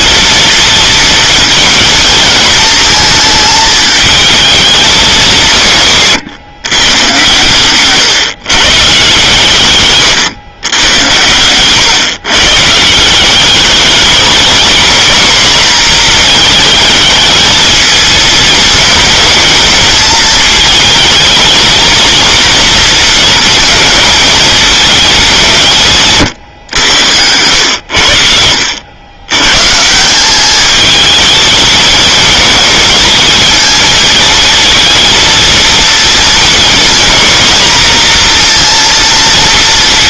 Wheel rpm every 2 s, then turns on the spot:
230, 230, 220, 120, 140, 130, 150, 220, 220, 220, 220, 230, 220, 110, 70, 210, 220, 220, 230, 240.
none